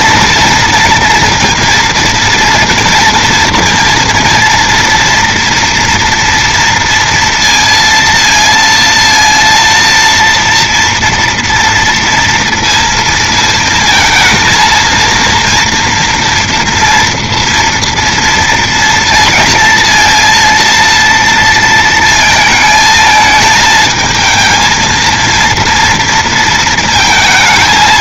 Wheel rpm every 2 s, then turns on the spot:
230, 230, 230, 230, 230, 230, 230, 230, 230, 230, 230, 220, 220, 230.
none